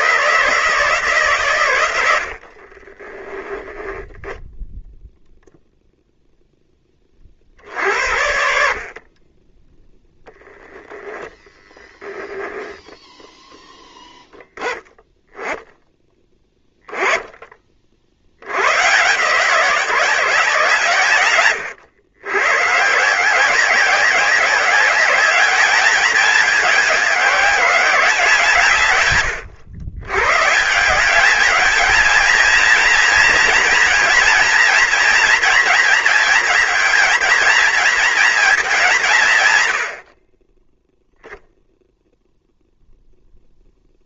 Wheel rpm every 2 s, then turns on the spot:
140, 20, 0, 30, 30, 0, 0, 10, 10, 130, 130, 160, 200, 200, 110, 190, 230, 230, 230, 190, 0, 0.
2-4